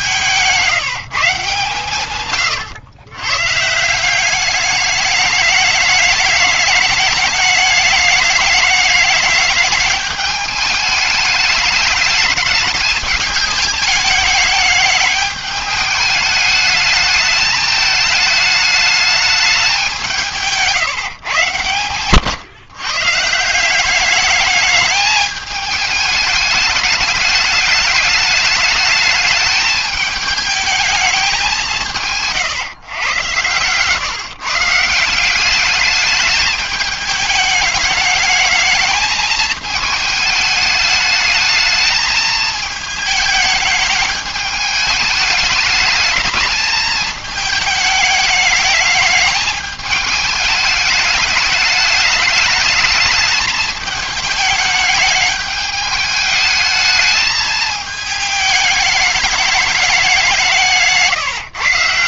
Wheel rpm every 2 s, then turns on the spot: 160, 120, 200, 210, 210, 210, 210, 210, 220, 210, 160, 140, 210, 210, 210, 210, 130, 150, 210, 220, 210, 210, 210, 210, 210, 210, 220, 210, 220, 210, 160.
none